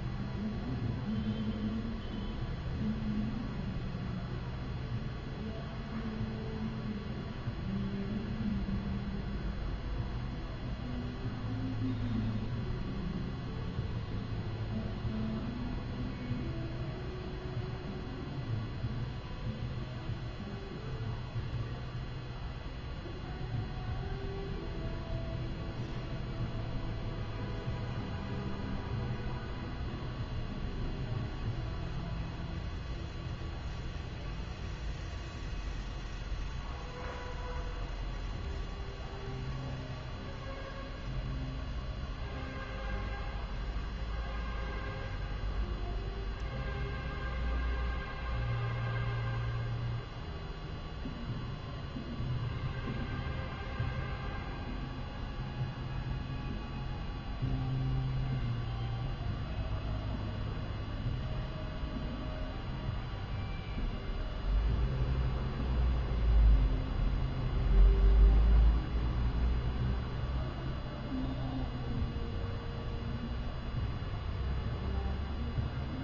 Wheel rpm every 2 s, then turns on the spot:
0, 0, 0, 0, 0, 0, 0, 0, 0, 0, 0, 0, 0, 0, 0, 0, 0, 0, 0, 0, 0, 0, 0, 0, 0, 0, 0, 0, 0, 0, 0, 0, 0, 0, 0, 0, 0, 0.
none